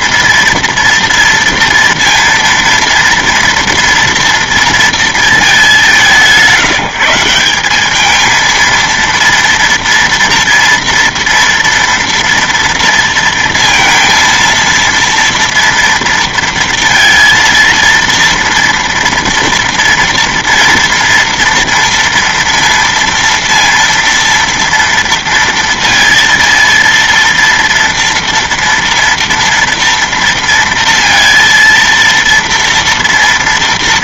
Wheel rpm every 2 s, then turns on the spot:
230, 230, 230, 180, 230, 240, 230, 230, 230, 230, 230, 230, 230, 230, 230, 230, 230.
none